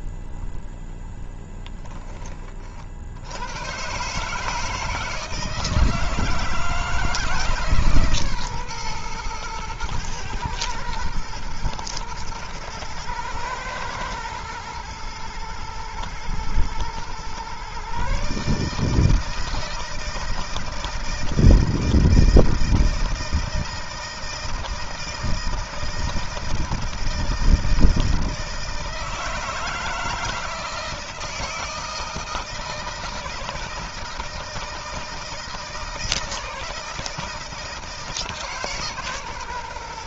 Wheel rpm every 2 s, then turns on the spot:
0, 30, 150, 160, 130, 120, 110, 110, 120, 150, 160, 160, 160, 160, 160, 160, 160, 160, 160, 150.
none